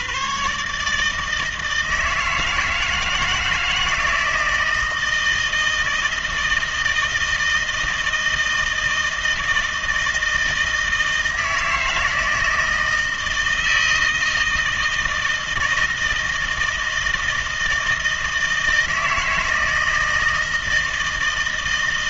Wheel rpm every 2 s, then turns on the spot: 150, 160, 160, 160, 160, 160, 160, 160, 160, 160, 160.
none